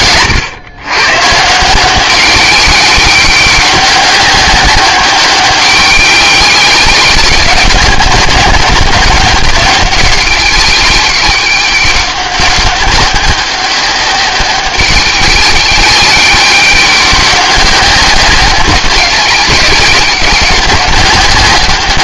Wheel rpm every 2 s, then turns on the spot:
120, 190, 190, 190, 190, 200, 200, 190, 200, 190, 190.
none